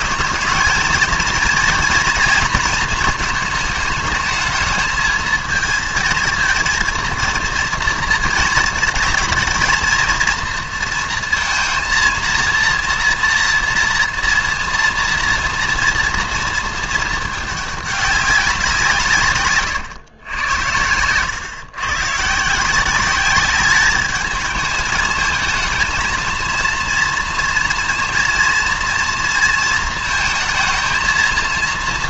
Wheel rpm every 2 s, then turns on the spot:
230, 230, 220, 230, 220, 230, 230, 230, 220, 180, 100, 180, 210, 230, 230, 230.
none